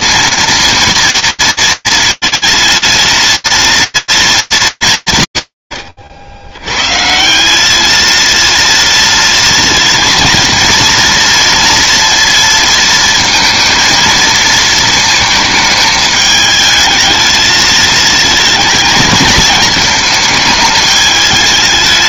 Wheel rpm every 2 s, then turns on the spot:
230, 230, 190, 120, 230, 230, 230, 220, 220, 220, 220.
none